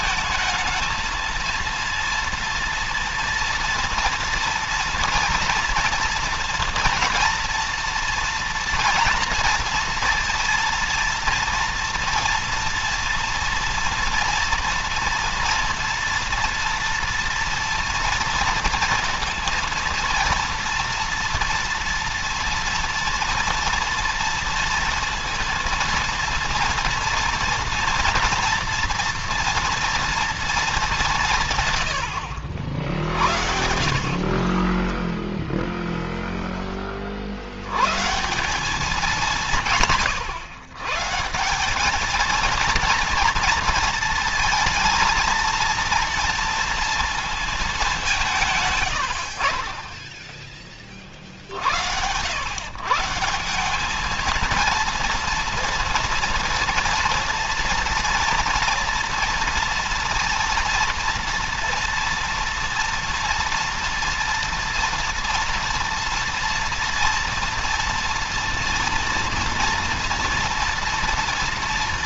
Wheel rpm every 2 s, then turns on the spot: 220, 230, 230, 230, 230, 230, 230, 230, 230, 230, 230, 230, 230, 230, 240, 230, 80, 40, 10, 150, 130, 230, 230, 230, 170, 10, 110, 220, 230, 230, 230, 230, 230, 230, 230, 230.
34-36